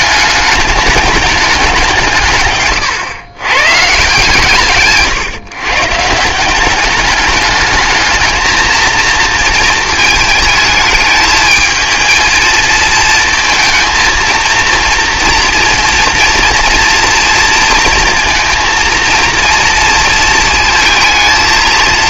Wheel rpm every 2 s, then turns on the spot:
210, 130, 140, 200, 230, 220, 230, 230, 230, 230, 230.
none